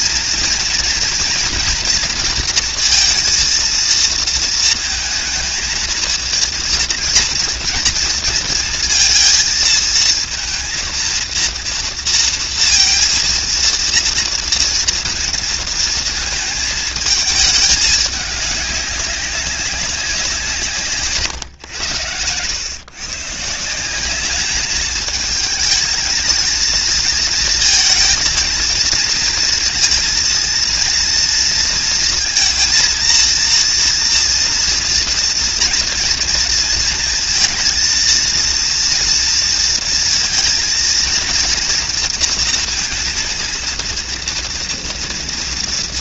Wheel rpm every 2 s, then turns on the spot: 230, 230, 230, 230, 230, 230, 230, 230, 230, 210, 180, 90, 200, 220, 230, 230, 230, 230, 230, 230, 230, 230, 230.
none